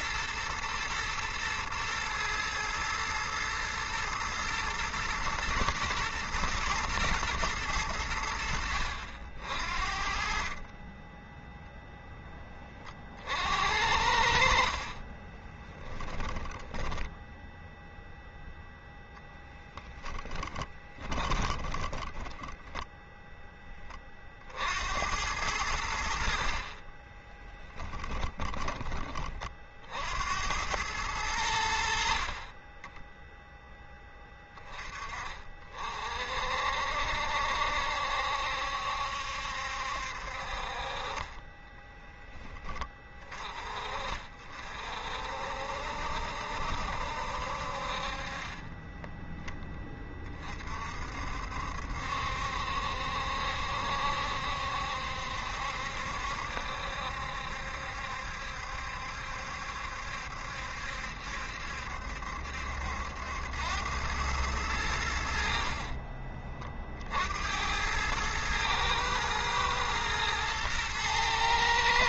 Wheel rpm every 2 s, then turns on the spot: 120, 110, 120, 110, 70, 10, 40, 40, 10, 0, 10, 0, 80, 30, 30, 100, 20, 30, 60, 70, 40, 20, 50, 70, 20, 50, 70, 70, 70, 70, 70, 80, 90, 50, 110, 110.
14-16 20-22 26-28 48-50